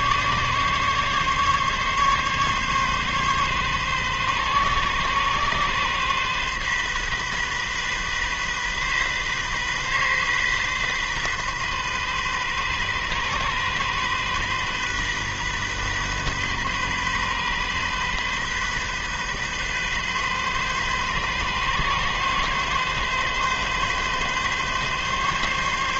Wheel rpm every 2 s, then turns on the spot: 140, 140, 140, 130, 130, 130, 130, 130, 130, 130, 130, 130, 140.
none